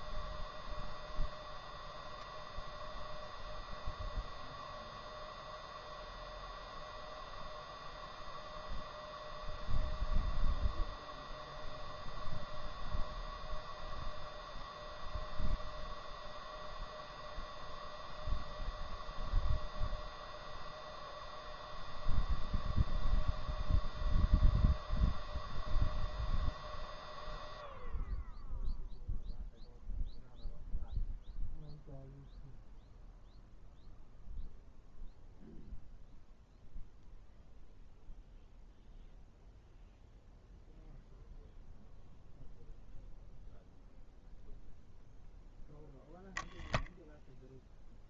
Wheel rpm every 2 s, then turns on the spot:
0, 0, 0, 0, 0, 0, 0, 0, 0, 0, 0, 0, 0, 0, 0, 0, 0, 0, 0, 0, 0, 0, 0, 0.
none